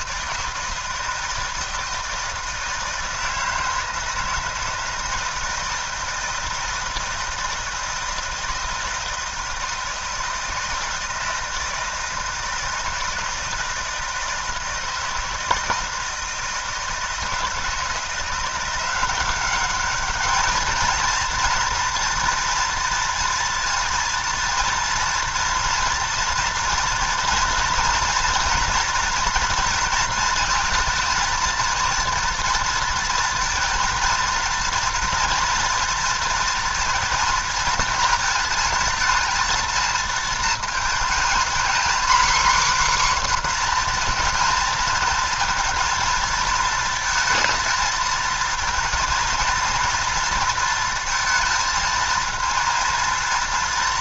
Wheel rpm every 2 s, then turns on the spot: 160, 160, 160, 160, 160, 160, 160, 160, 160, 180, 210, 230, 230, 230, 240, 230, 230, 230, 230, 230, 220, 270, 230, 230, 230, 230, 230.
none